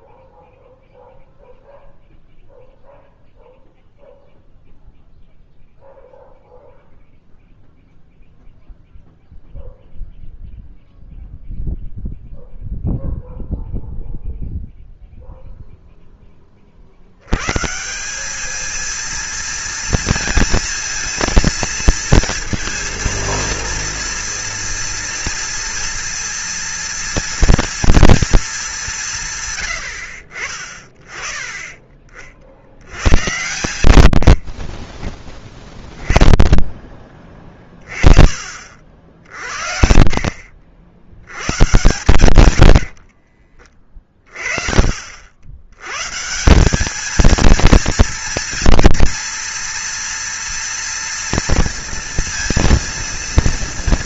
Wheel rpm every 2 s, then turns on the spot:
0, 0, 0, 0, 0, 0, 0, 0, 20, 210, 230, 230, 230, 230, 210, 40, 70, 50, 10, 40, 60, 90, 40, 180, 230, 230, 230.
34-36